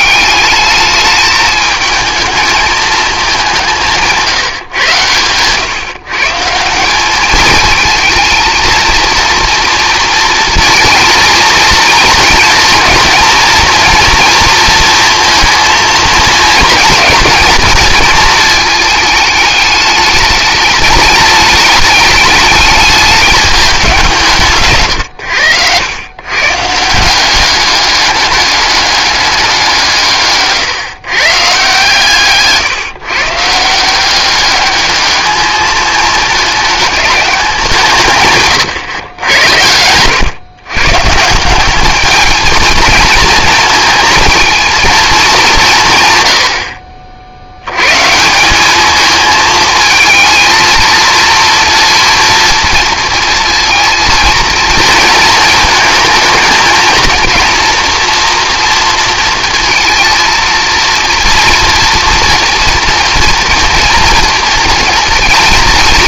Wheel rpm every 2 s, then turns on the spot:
210, 220, 150, 170, 220, 220, 230, 230, 230, 220, 210, 210, 140, 140, 210, 140, 130, 200, 210, 130, 130, 220, 230, 80, 190, 230, 230, 230, 220, 240, 230, 230, 230.
none